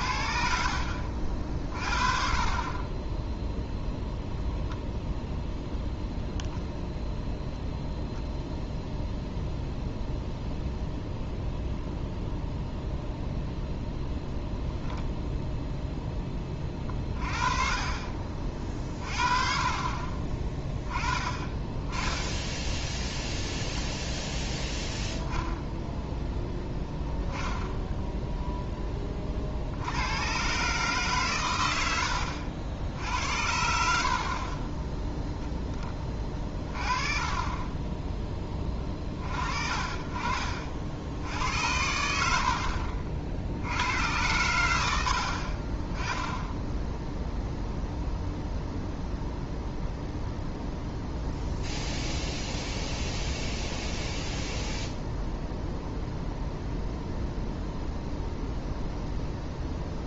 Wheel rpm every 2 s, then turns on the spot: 60, 30, 0, 0, 0, 0, 0, 0, 20, 40, 20, 0, 0, 0, 10, 130, 70, 20, 20, 20, 40, 70, 100, 10, 0, 0, 0, 0, 0, 0.
0-2 34-38